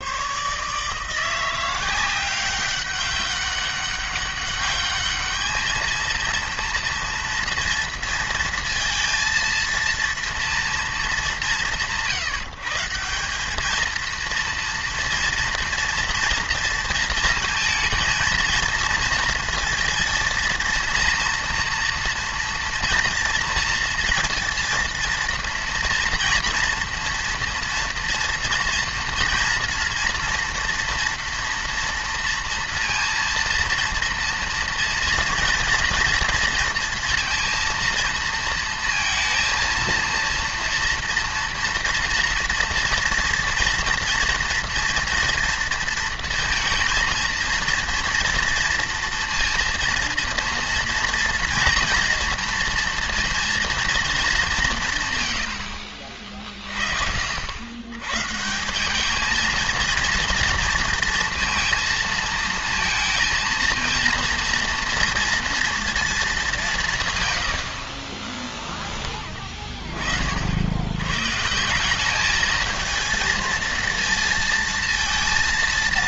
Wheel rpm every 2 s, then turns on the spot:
150, 190, 200, 230, 230, 230, 160, 230, 230, 230, 230, 230, 230, 230, 230, 230, 230, 230, 230, 230, 230, 230, 230, 230, 230, 230, 230, 180, 40, 180, 230, 230, 230, 170, 10, 80, 220, 230.
none